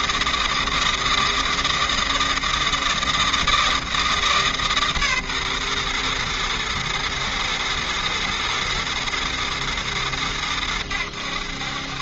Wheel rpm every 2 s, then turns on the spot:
160, 160, 130, 120, 120, 90.
none